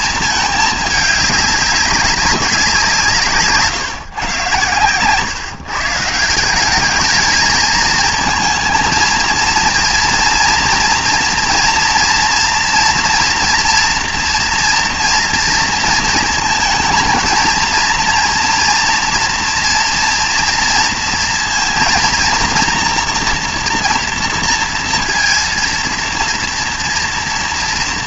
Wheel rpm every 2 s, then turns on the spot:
210, 190, 120, 190, 230, 230, 240, 240, 230, 230, 230, 230, 230, 230.
none